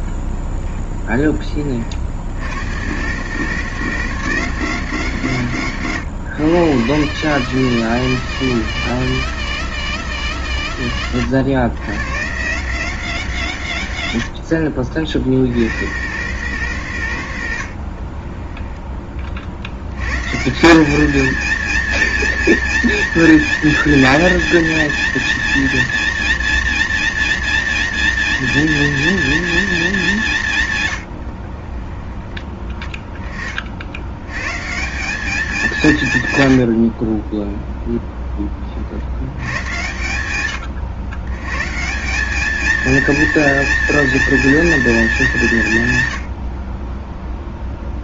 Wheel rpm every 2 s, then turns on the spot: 10, 100, 160, 120, 160, 140, 120, 60, 130, 10, 160, 230, 230, 230, 230, 160, 10, 130, 90, 30, 90, 200, 210, 60.
14-16 18-20